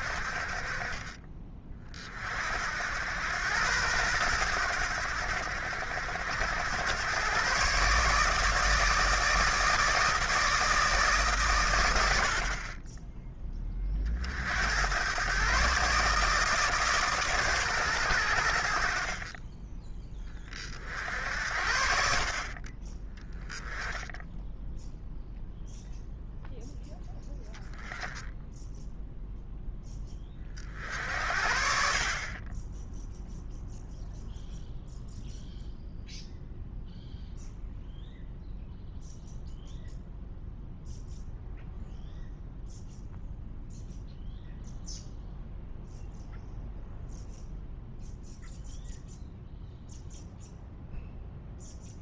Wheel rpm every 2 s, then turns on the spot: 30, 70, 90, 100, 150, 150, 30, 90, 150, 60, 50, 30, 0, 10, 0, 50, 10, 0, 0, 0, 0, 0, 0, 0, 0, 0.
none